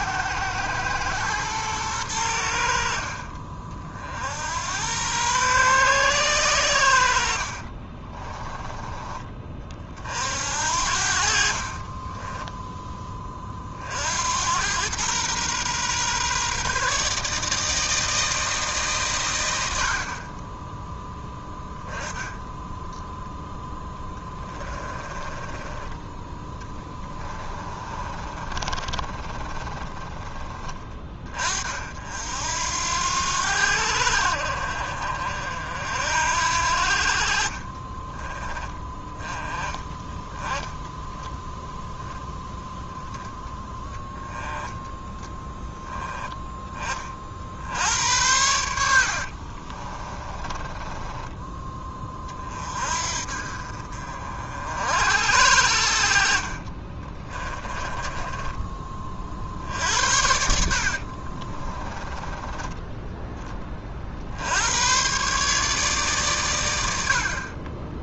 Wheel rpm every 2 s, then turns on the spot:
110, 60, 90, 90, 20, 60, 10, 100, 140, 160, 20, 10, 30, 10, 30, 20, 80, 50, 60, 20, 10, 10, 10, 20, 80, 20, 40, 60, 40, 20, 60, 10, 90, 110.
24-30 50-52 56-58 60-62